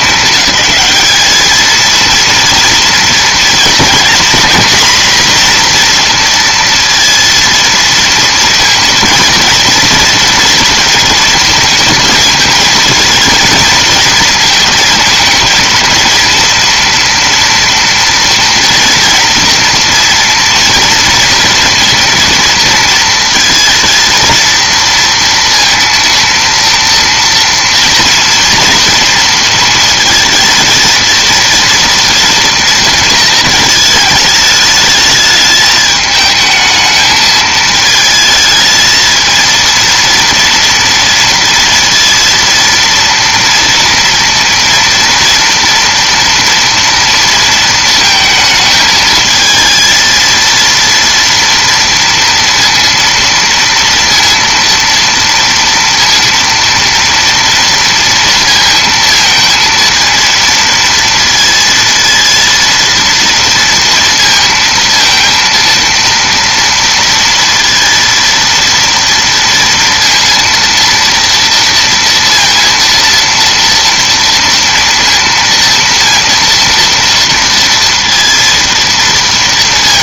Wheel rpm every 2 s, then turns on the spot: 200, 230, 250, 230, 230, 230, 220, 220, 230, 230, 230, 230, 230, 230, 230, 230, 230, 210, 220, 220, 230, 230, 230, 230, 220, 230, 230, 230, 230, 230, 230, 230, 230, 230, 230, 230, 230, 230, 230, 230.
none